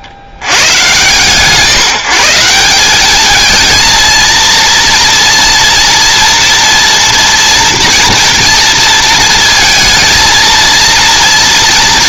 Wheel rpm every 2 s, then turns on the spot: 70, 200, 230, 240, 240, 230.
none